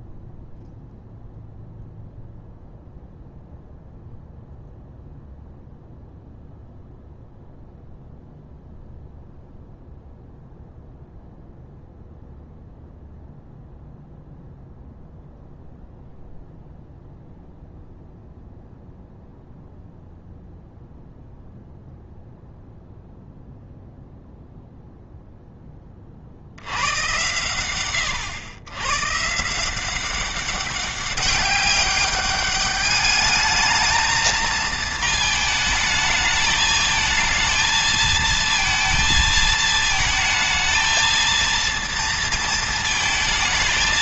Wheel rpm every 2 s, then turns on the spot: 0, 0, 0, 0, 0, 0, 0, 0, 0, 0, 0, 0, 0, 90, 120, 200, 210, 220, 220, 230, 220, 230.
none